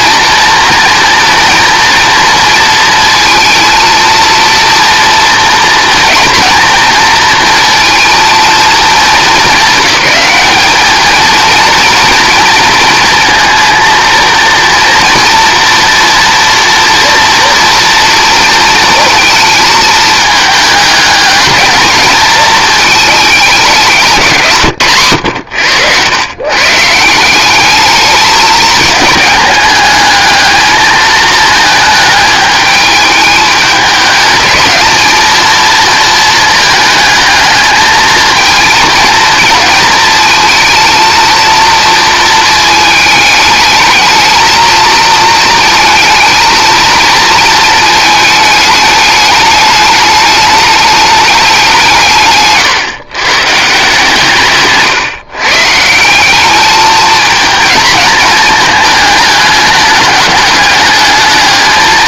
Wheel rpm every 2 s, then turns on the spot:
230, 230, 230, 230, 220, 210, 230, 230, 230, 230, 210, 220, 120, 140, 220, 220, 210, 220, 220, 220, 230, 220, 220, 220, 210, 210, 140, 140, 210, 220, 210.
none